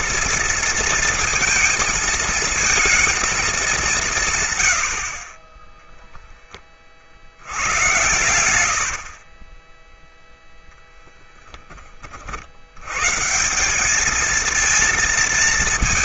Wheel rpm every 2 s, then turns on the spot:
230, 230, 100, 20, 90, 0, 90, 230.
8-10